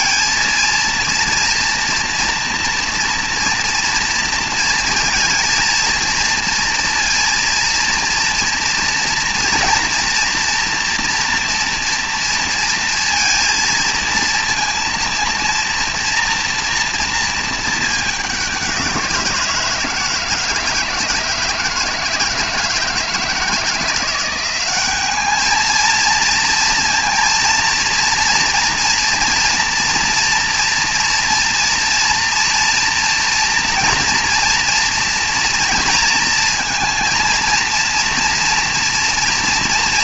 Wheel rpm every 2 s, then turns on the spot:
230, 240, 220, 230, 230, 240, 230, 230, 230, 190, 160, 160, 190, 230, 230, 230, 240, 230, 230, 230.
none